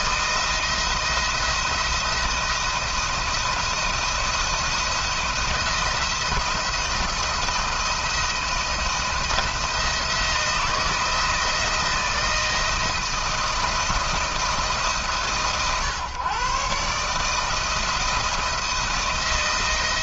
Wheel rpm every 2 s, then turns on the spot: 170, 170, 160, 170, 170, 160, 160, 150, 130, 160.
none